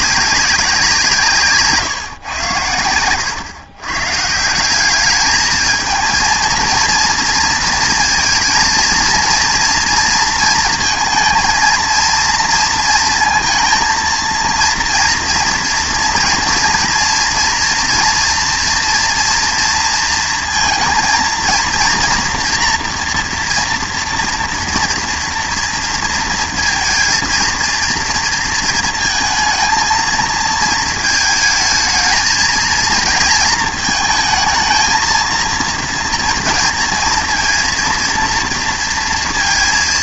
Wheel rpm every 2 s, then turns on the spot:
190, 110, 180, 230, 220, 230, 230, 230, 240, 240, 230, 240, 240, 230, 230, 230, 230, 230, 230, 230.
none